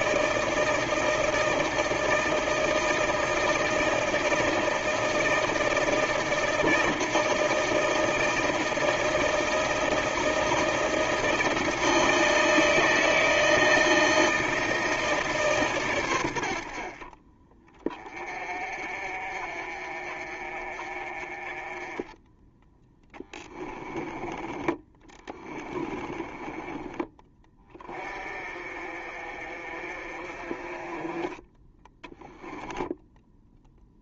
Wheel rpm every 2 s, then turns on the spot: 160, 160, 160, 160, 160, 160, 160, 160, 60, 40, 40, 10, 20, 20, 40, 30, 10.
24-26